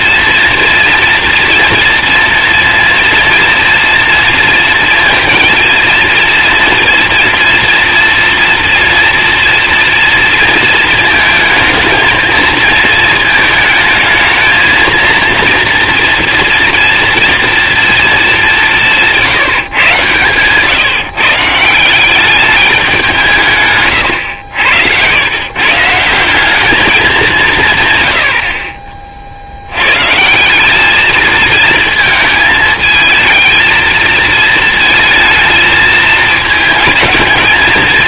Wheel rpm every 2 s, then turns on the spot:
230, 230, 230, 230, 230, 220, 220, 230, 240, 160, 150, 170, 110, 200, 50, 220, 220, 220, 220.
none